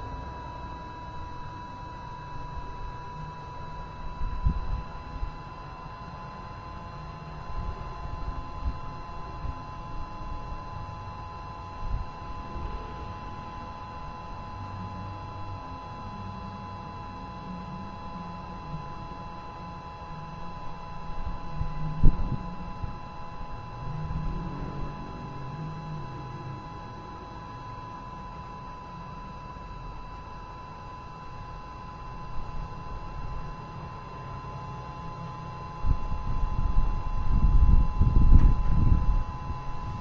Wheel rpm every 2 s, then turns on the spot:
0, 0, 0, 0, 0, 0, 0, 0, 0, 0, 0, 0, 0, 0, 0, 0, 0, 0, 0, 0.
none